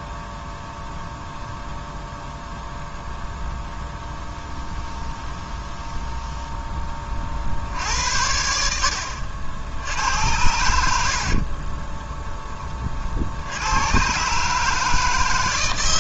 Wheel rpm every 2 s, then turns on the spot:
0, 0, 0, 20, 60, 90, 40, 150.
10-12